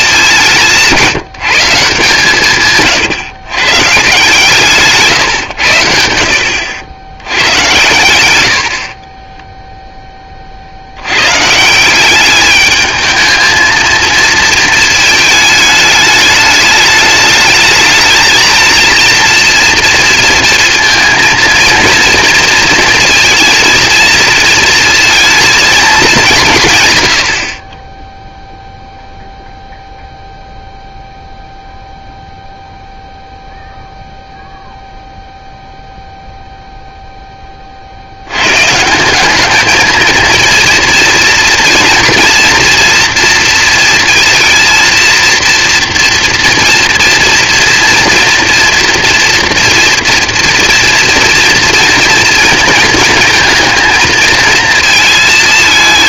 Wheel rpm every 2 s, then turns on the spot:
180, 140, 160, 80, 50, 50, 210, 230, 210, 230, 230, 230, 230, 150, 0, 0, 0, 0, 0, 130, 230, 230, 230, 230, 230, 230, 220, 220.
2-4